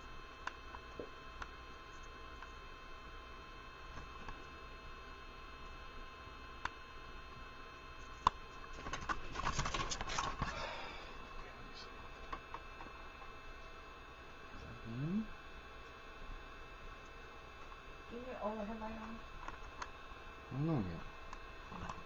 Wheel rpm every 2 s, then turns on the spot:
0, 0, 0, 0, 0, 0, 0, 0, 0, 0, 0.
none